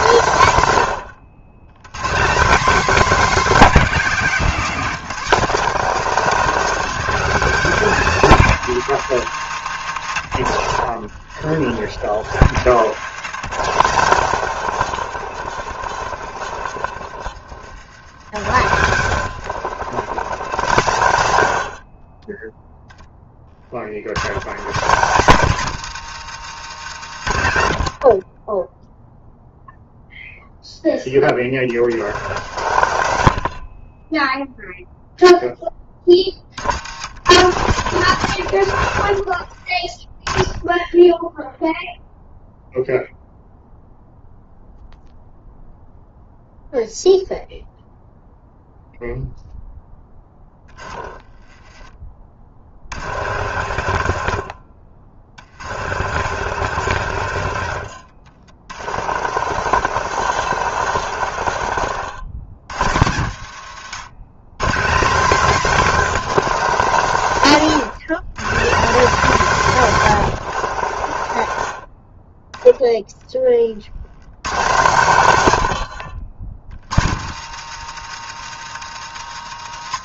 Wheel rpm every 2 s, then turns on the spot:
160, 250, 230, 230, 200, 110, 100, 140, 70, 110, 140, 10, 150, 180, 30, 0, 120, 0, 80, 110, 20, 0, 0, 0, 0, 10, 50, 50, 120, 70, 130, 100, 140, 200, 180, 130, 20, 160, 90, 160.
52-62 70-72